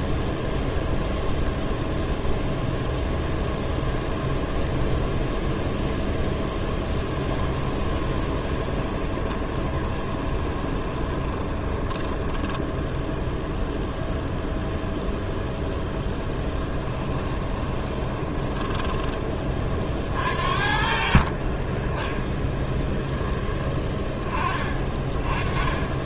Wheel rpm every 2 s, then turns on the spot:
0, 0, 0, 10, 20, 20, 10, 0, 20, 10, 60, 10, 20.
6-12 16-18 22-24